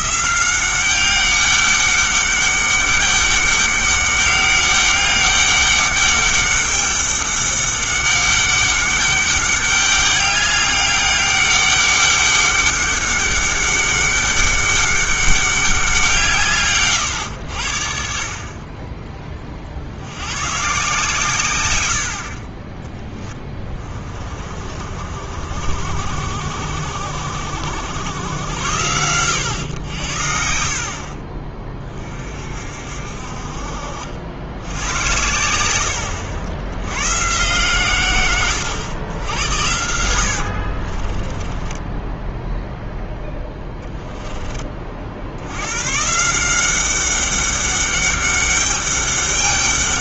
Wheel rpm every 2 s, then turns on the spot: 190, 200, 200, 200, 200, 200, 200, 200, 140, 30, 130, 20, 40, 60, 90, 60, 50, 90, 90, 100, 60, 0, 30, 180, 200.
22-24 30-32 40-42